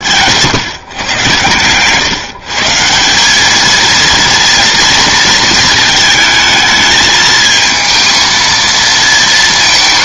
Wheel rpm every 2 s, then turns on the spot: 130, 150, 230, 220, 230.
none